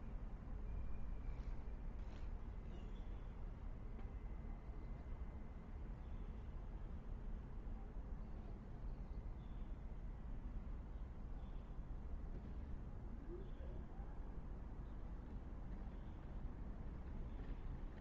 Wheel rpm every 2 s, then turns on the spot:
0, 0, 0, 0, 0, 0, 0, 0, 0.
none